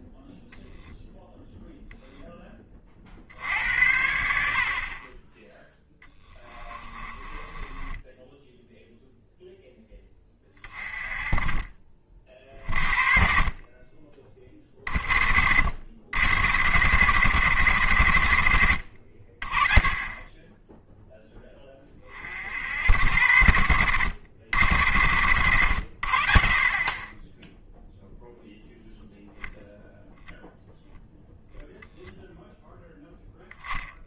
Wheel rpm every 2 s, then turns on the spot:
0, 30, 50, 20, 0, 30, 40, 40, 110, 60, 10, 80, 100, 40, 0, 0, 0.
6-8